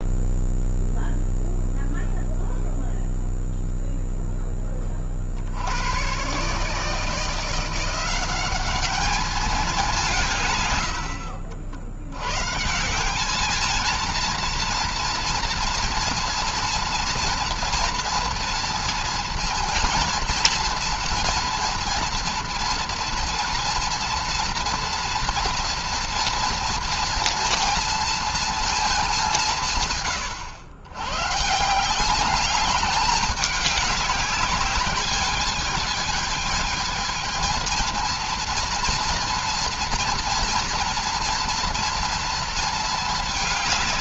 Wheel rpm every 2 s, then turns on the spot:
0, 0, 10, 140, 190, 130, 120, 230, 230, 230, 230, 230, 230, 240, 230, 110, 200, 200, 220, 230, 230, 230.
none